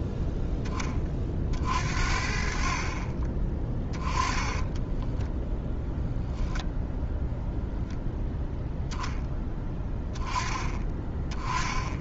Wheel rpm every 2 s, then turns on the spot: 20, 40, 10, 0, 0, 10.
4-6